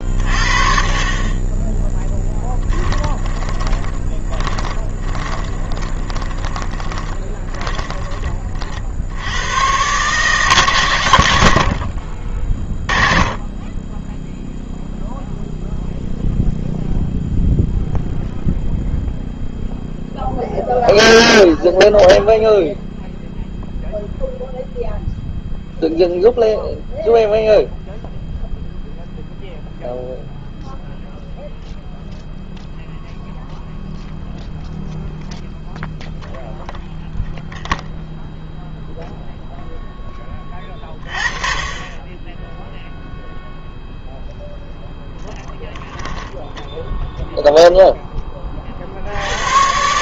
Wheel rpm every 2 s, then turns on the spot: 50, 10, 20, 20, 40, 120, 30, 0, 0, 0, 0, 0, 0, 0, 0, 0, 0, 0, 0, 0, 30, 0, 0, 10, 40.
2-8 46-48